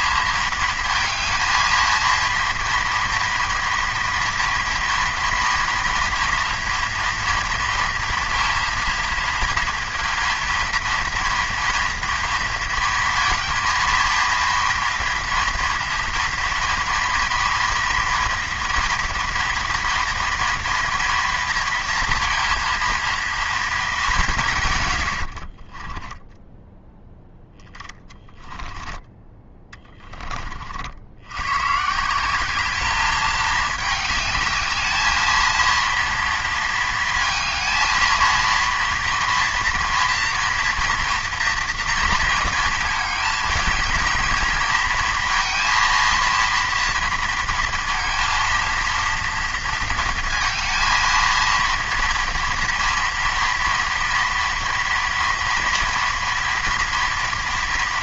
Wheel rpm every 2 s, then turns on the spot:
220, 230, 240, 230, 230, 230, 230, 240, 230, 230, 230, 230, 80, 0, 10, 90, 210, 220, 230, 230, 230, 220, 230, 230, 230, 230, 230, 230, 240.
24-26